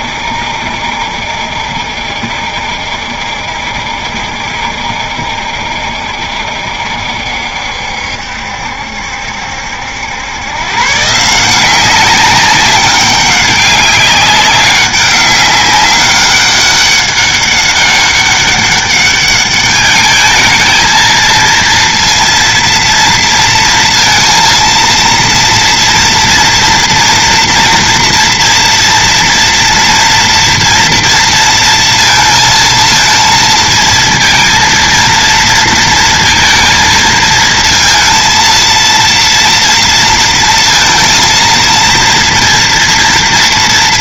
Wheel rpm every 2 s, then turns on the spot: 70, 70, 70, 70, 70, 120, 190, 200, 200, 200, 220, 230, 230, 230, 230, 230, 230, 230, 230, 230, 230, 230.
none